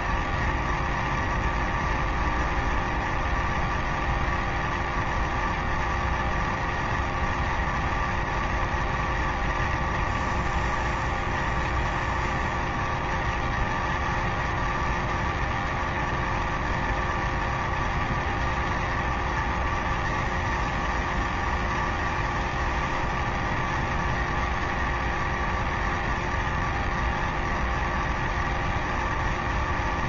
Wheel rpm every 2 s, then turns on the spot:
0, 0, 0, 0, 0, 0, 0, 0, 0, 0, 0, 0, 0, 0, 0.
none